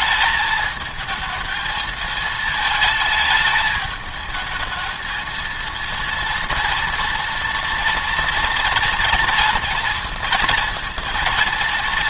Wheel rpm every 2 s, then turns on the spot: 220, 220, 220, 230, 230, 230.
none